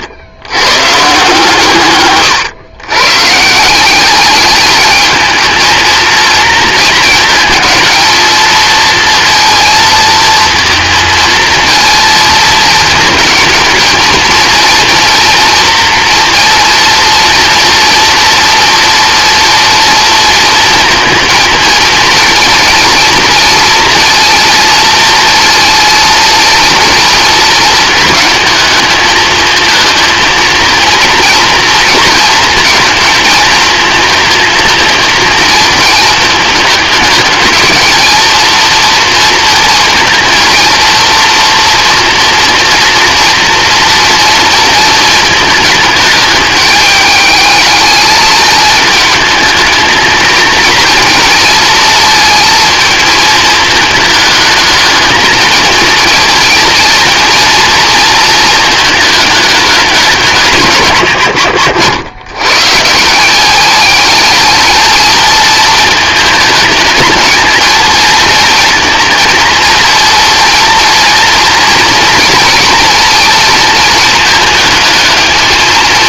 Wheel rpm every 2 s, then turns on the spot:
140, 120, 210, 220, 230, 230, 220, 230, 230, 240, 230, 230, 230, 230, 220, 230, 230, 230, 210, 230, 220, 230, 220, 220, 220, 230, 230, 220, 220, 220, 120, 170, 220, 220, 230, 230, 220, 220.
none